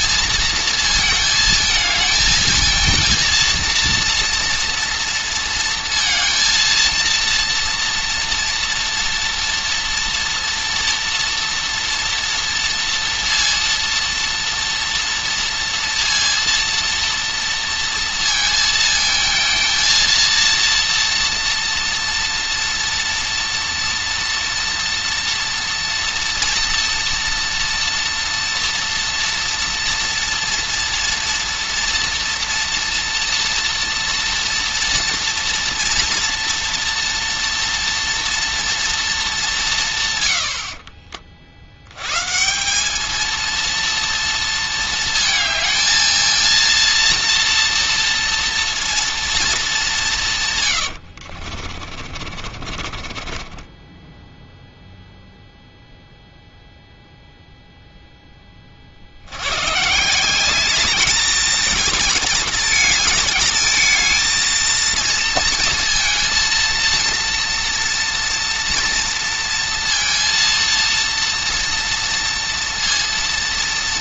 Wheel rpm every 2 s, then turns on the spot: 230, 230, 230, 230, 240, 240, 230, 230, 230, 230, 230, 240, 240, 230, 230, 230, 230, 230, 230, 240, 60, 180, 230, 230, 230, 110, 40, 0, 0, 30, 200, 220, 220, 230, 230, 230, 230.
40-42 52-54